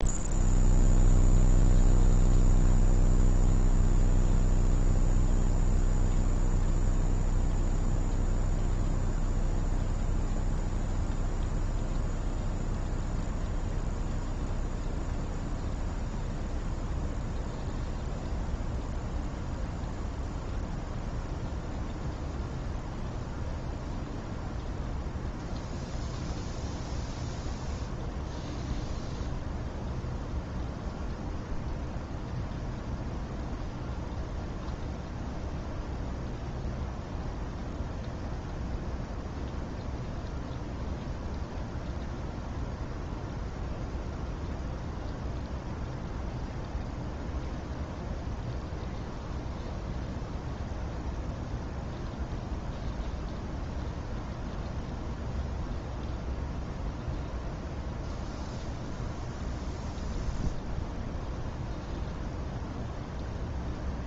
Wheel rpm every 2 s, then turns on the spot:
0, 0, 0, 0, 0, 0, 0, 0, 0, 0, 0, 0, 0, 0, 0, 0, 0, 0, 0, 0, 0, 0, 0, 0, 0, 0, 0, 0, 0, 0, 0, 0.
none